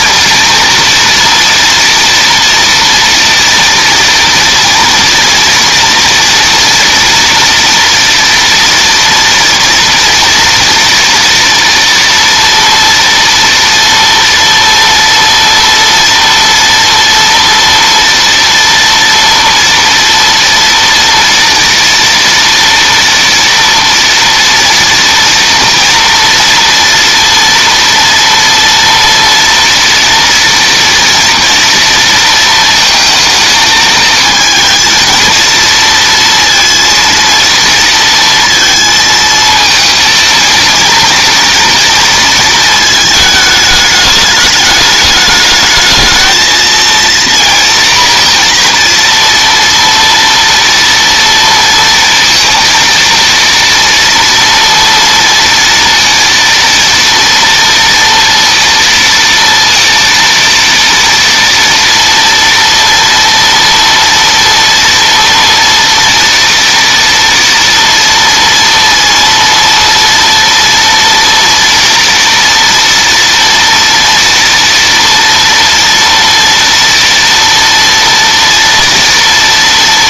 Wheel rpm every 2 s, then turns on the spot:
230, 230, 230, 240, 230, 230, 230, 230, 230, 230, 230, 230, 230, 230, 230, 230, 230, 220, 230, 230, 230, 230, 210, 220, 230, 230, 230, 230, 230, 230, 230, 230, 230, 230, 230, 230, 230, 230, 230, 230.
none